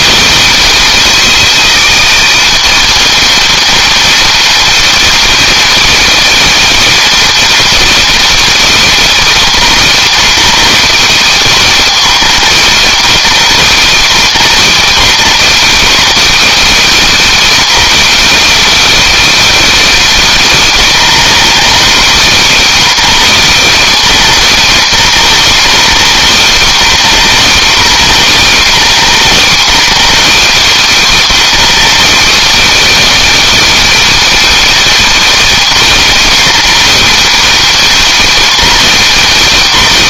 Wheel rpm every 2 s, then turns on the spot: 320, 350, 350, 350, 330, 310, 300, 300, 330, 340, 290, 310, 280, 280, 280, 310, 340, 340, 320, 330.
none